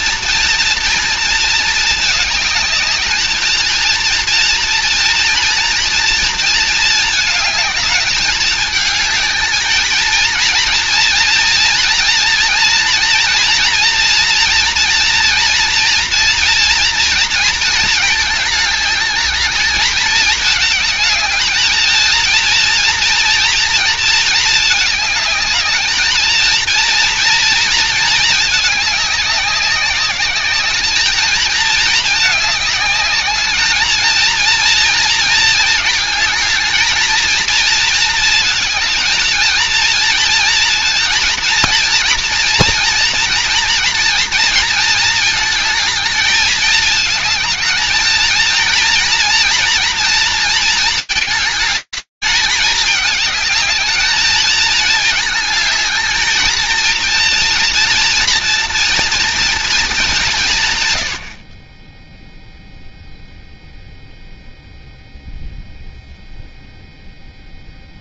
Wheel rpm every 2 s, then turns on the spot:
230, 220, 230, 220, 220, 230, 240, 230, 230, 210, 220, 230, 210, 230, 200, 210, 210, 220, 230, 220, 230, 230, 220, 220, 230, 220, 210, 220, 220, 230, 140, 0, 0, 0.
none